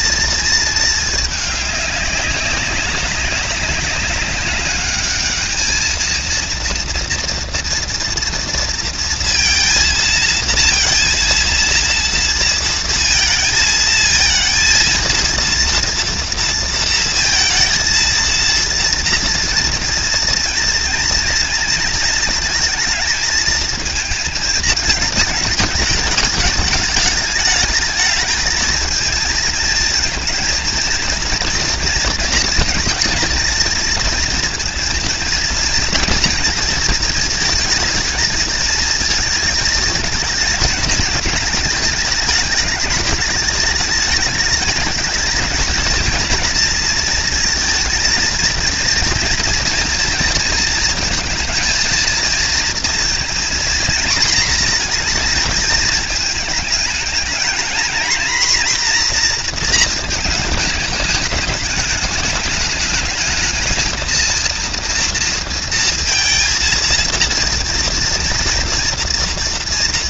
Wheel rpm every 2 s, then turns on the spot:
220, 200, 210, 230, 230, 230, 230, 230, 230, 230, 240, 220, 210, 210, 220, 220, 230, 230, 230, 220, 220, 200, 220, 230, 230, 230, 230, 230, 220, 240, 210, 220, 230, 230, 240.
none